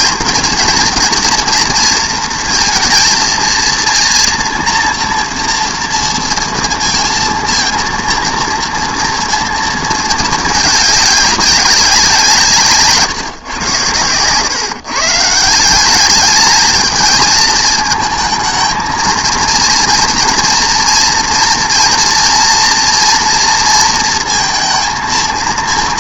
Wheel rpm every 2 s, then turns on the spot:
240, 230, 230, 230, 230, 210, 160, 130, 210, 230, 230, 230, 220.
none